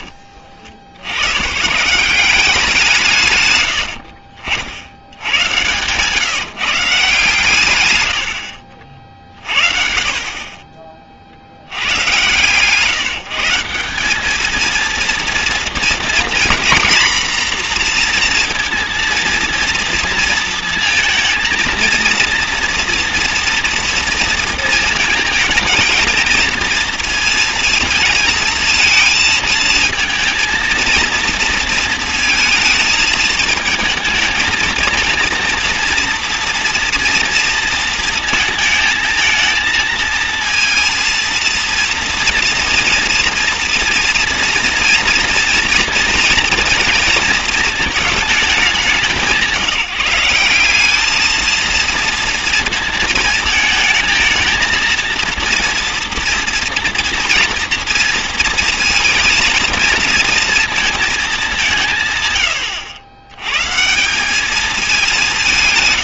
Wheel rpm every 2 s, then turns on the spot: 60, 180, 70, 150, 60, 20, 150, 230, 240, 230, 230, 240, 230, 220, 220, 230, 220, 220, 240, 220, 230, 230, 230, 230, 190, 200, 230, 220, 230, 230, 230, 100, 210.
none